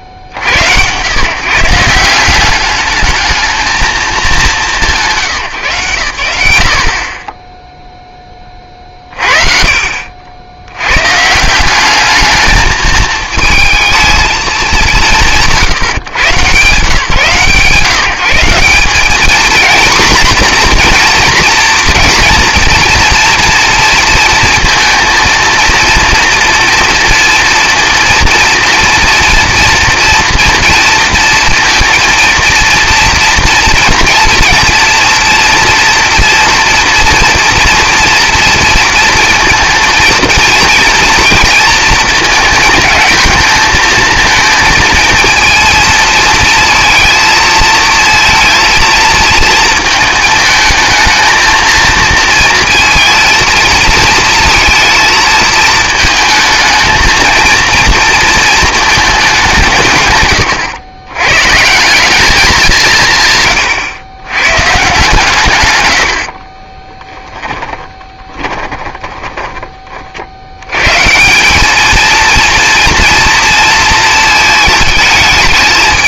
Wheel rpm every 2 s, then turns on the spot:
90, 190, 190, 120, 30, 80, 210, 210, 170, 180, 240, 230, 230, 230, 230, 230, 230, 230, 230, 230, 230, 220, 220, 220, 230, 220, 230, 230, 220, 230, 120, 190, 130, 40, 20, 80, 230, 220.
66-70